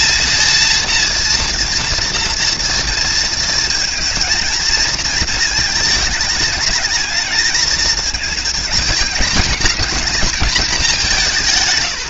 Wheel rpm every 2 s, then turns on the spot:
230, 230, 230, 210, 220, 200.
none